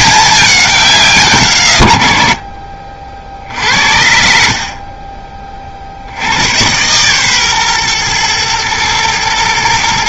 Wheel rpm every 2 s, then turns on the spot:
190, 60, 50, 110, 110.
none